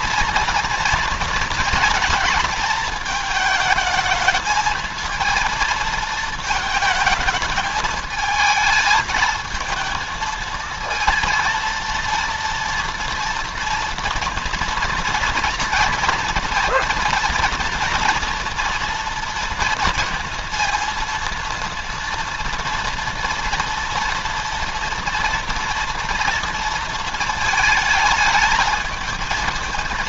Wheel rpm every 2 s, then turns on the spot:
230, 220, 230, 220, 220, 220, 230, 230, 230, 230, 230, 230, 230, 230, 220.
none